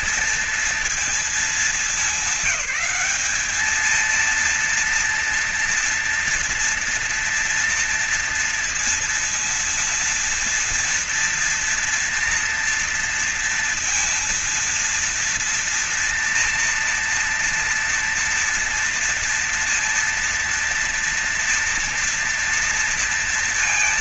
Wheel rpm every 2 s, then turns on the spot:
220, 200, 230, 230, 230, 230, 240, 230, 230, 230, 230, 230.
none